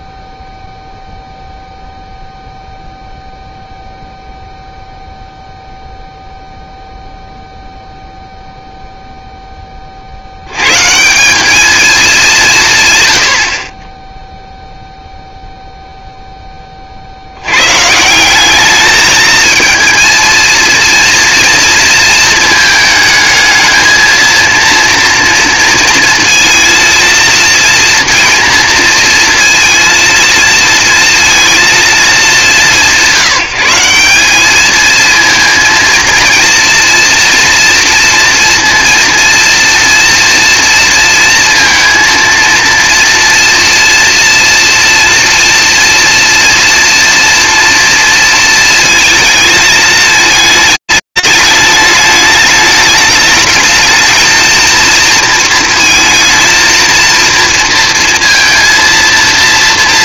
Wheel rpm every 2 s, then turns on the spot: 0, 0, 0, 0, 0, 120, 170, 0, 40, 210, 230, 220, 230, 230, 230, 230, 190, 220, 240, 230, 230, 230, 230, 230, 220, 210, 210, 230, 230, 230.
none